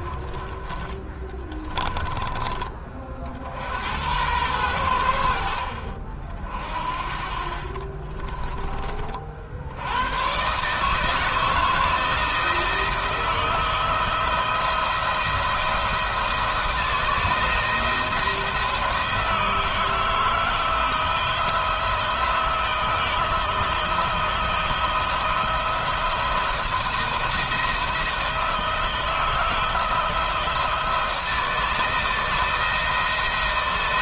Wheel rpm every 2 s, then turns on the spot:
20, 40, 90, 40, 30, 140, 160, 170, 160, 170, 170, 160, 170, 170, 160, 170, 170.
none